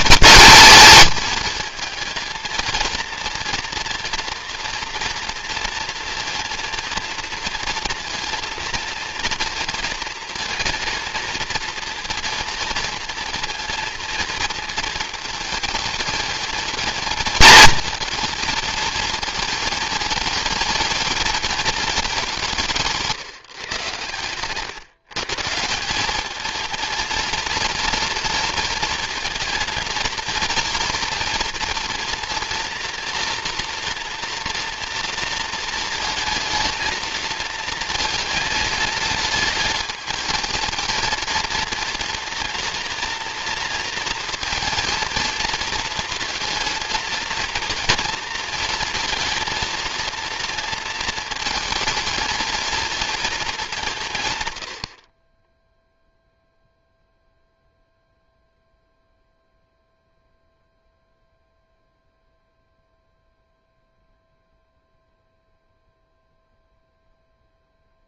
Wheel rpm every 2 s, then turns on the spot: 220, 230, 230, 230, 230, 230, 230, 220, 230, 230, 220, 160, 140, 220, 230, 230, 230, 240, 220, 220, 220, 230, 230, 230, 220, 230, 230, 80, 0, 0, 0, 0, 0, 0.
none